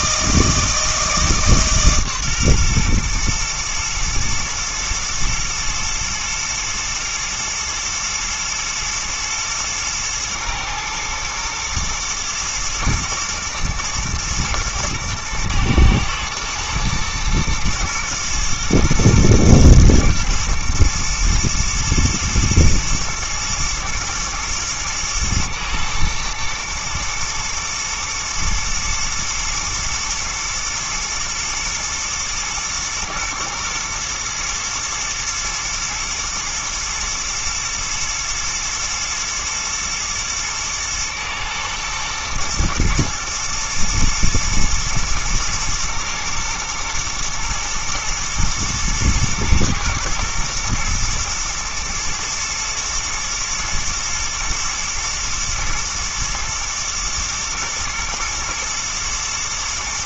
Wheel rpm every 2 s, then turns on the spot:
160, 130, 120, 110, 110, 110, 110, 110, 110, 110, 110, 120, 120, 110, 120, 120, 110, 110, 120, 120, 120, 110, 120, 120, 110, 120, 110, 110, 120, 110.
none